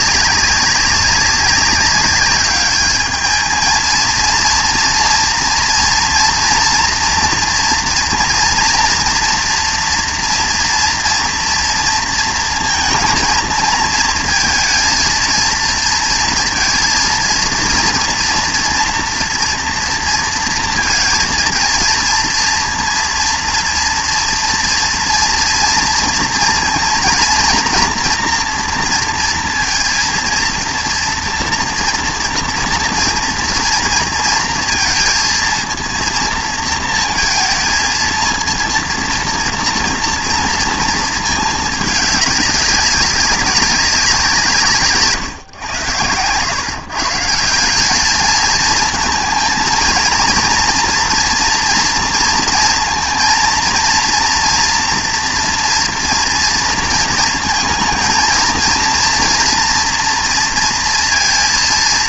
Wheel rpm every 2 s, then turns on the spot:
200, 200, 230, 230, 230, 230, 230, 230, 230, 230, 230, 230, 230, 230, 240, 230, 230, 230, 230, 230, 230, 200, 160, 120, 220, 230, 230, 240, 230, 220, 230.
none